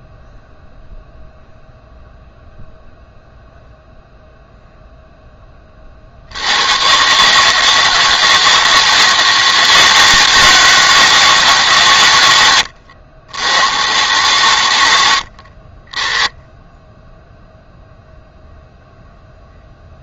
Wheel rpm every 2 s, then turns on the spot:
0, 0, 20, 150, 160, 150, 90, 50, 0, 0.
none